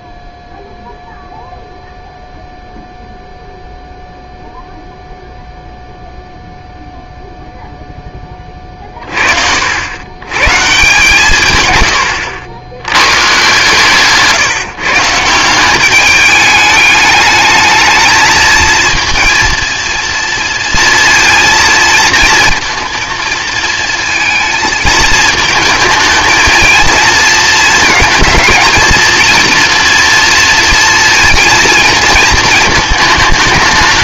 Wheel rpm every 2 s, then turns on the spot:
0, 0, 0, 0, 30, 130, 100, 150, 210, 230, 230, 230, 220, 220, 230, 230, 220.
none